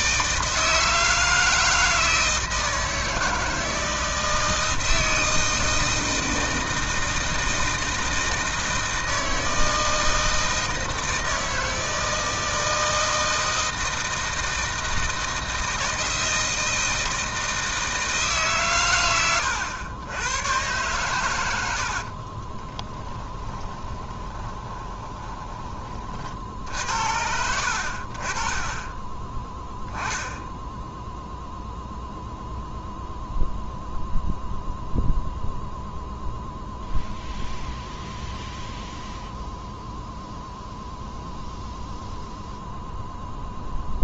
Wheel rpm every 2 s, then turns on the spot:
160, 160, 160, 160, 160, 160, 160, 160, 160, 130, 110, 10, 20, 70, 20, 0, 0, 0, 0, 0, 0, 0.
22-26